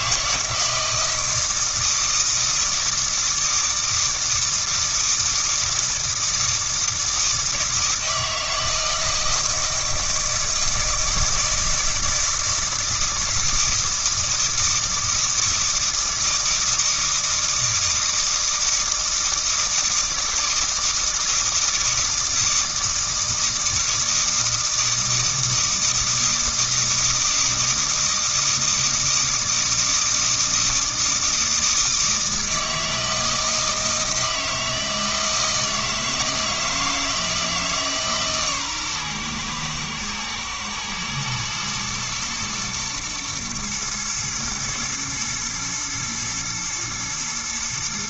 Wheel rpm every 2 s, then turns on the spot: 160, 160, 160, 160, 160, 160, 160, 160, 160, 160, 160, 160, 160, 160, 160, 160, 160, 160, 160, 130, 110, 110, 120, 120.
none